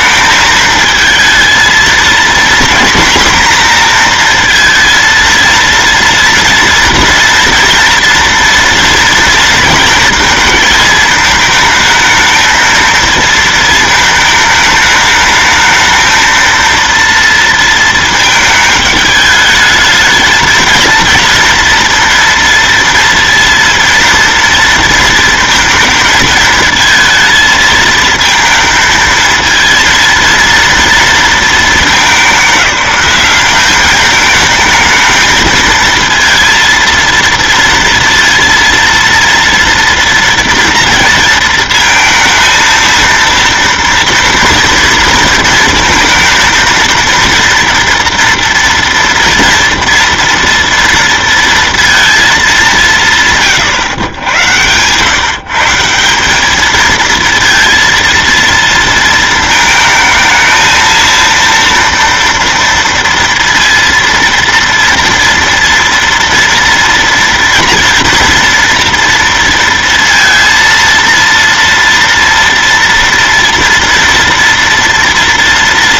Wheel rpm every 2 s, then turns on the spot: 220, 240, 230, 230, 230, 230, 220, 220, 230, 220, 220, 230, 230, 220, 220, 230, 200, 210, 230, 230, 230, 230, 230, 230, 240, 230, 200, 110, 210, 230, 220, 230, 230, 240, 240, 230, 230, 230.
none